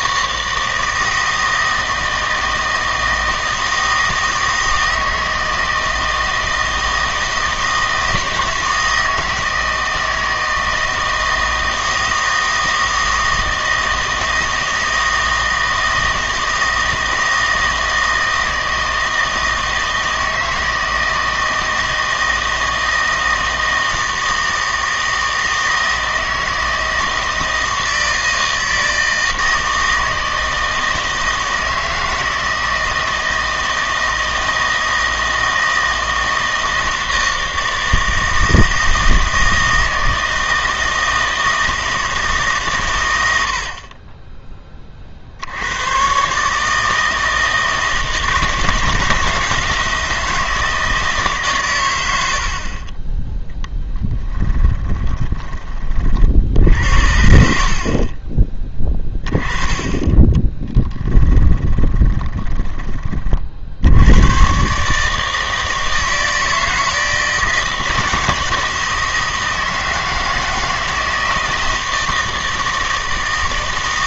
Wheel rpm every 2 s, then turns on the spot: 160, 160, 160, 160, 160, 160, 160, 160, 160, 160, 160, 160, 160, 160, 160, 160, 160, 160, 160, 160, 160, 130, 30, 150, 160, 160, 40, 10, 70, 10, 10, 20, 140, 160, 160, 160, 160.
52-56 60-62